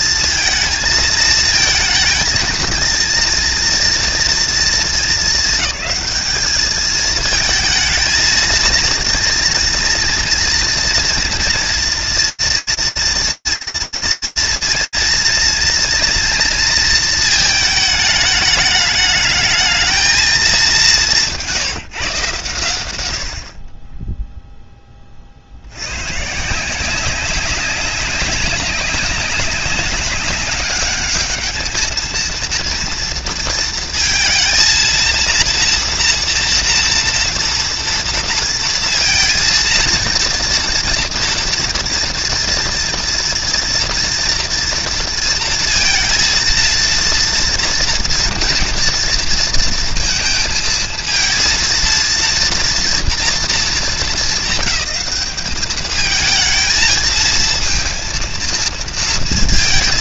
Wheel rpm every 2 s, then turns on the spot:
220, 230, 220, 220, 230, 230, 230, 230, 220, 210, 180, 80, 30, 180, 190, 210, 230, 230, 230, 230, 240, 230, 230, 230, 230, 230, 230, 200, 220, 220.
none